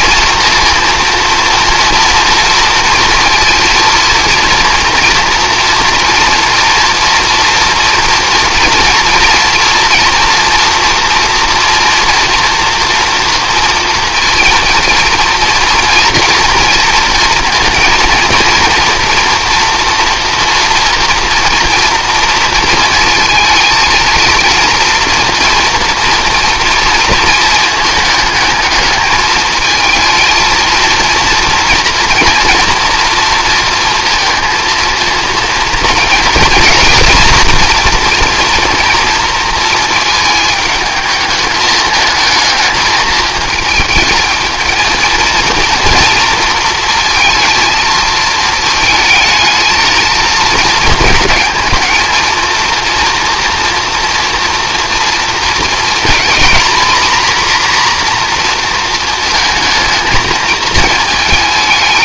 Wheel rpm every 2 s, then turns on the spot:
230, 240, 240, 230, 230, 240, 230, 230, 230, 240, 230, 220, 240, 230, 220, 230, 240, 230, 240, 230, 220, 220, 220, 230, 220, 220, 230, 230, 240, 230, 220.
none